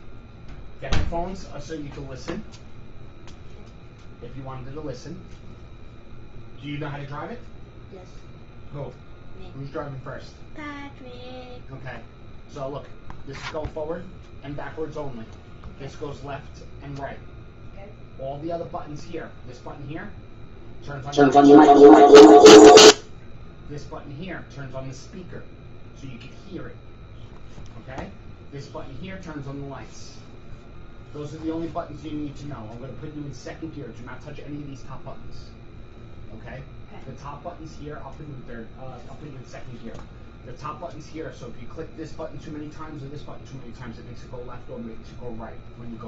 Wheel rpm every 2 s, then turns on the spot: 0, 0, 0, 0, 0, 0, 0, 0, 0, 0, 0, 0, 0, 0, 0, 0, 0, 0, 0, 0, 0, 0, 0.
none